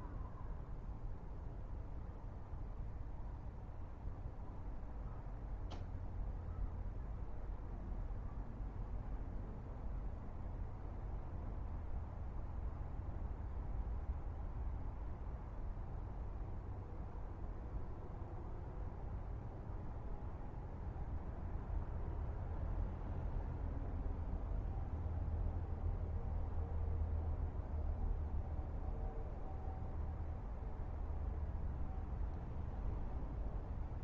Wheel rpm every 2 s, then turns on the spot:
0, 0, 0, 0, 0, 0, 0, 0, 0, 0, 0, 0, 0, 0, 0, 0, 0.
none